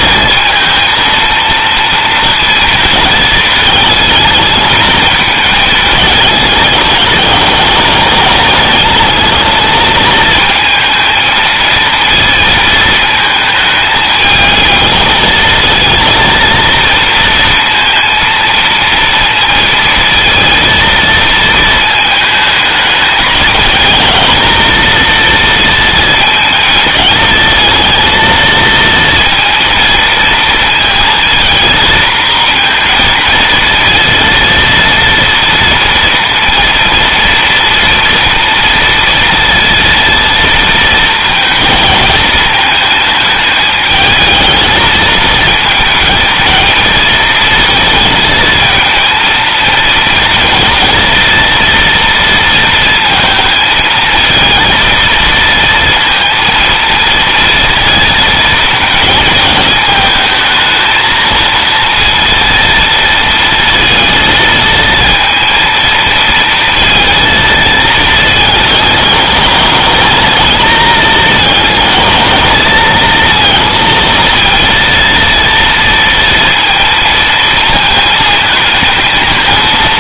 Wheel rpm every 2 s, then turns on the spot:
230, 230, 220, 210, 210, 230, 220, 220, 230, 230, 230, 220, 230, 220, 230, 220, 230, 230, 230, 230, 230, 220, 220, 230, 220, 240, 230, 230, 230, 230, 230, 230, 230, 230, 210, 220, 230, 230, 230, 230.
none